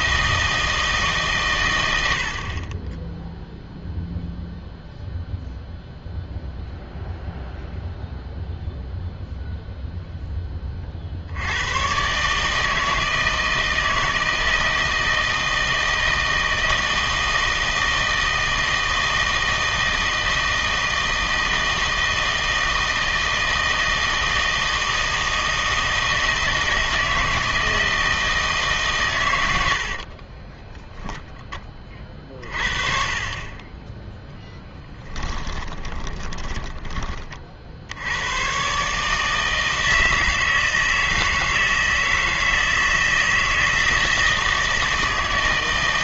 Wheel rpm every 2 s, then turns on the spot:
160, 30, 0, 0, 0, 30, 160, 160, 160, 160, 160, 160, 160, 160, 140, 10, 40, 10, 20, 130, 160, 160, 160.
30-32 34-38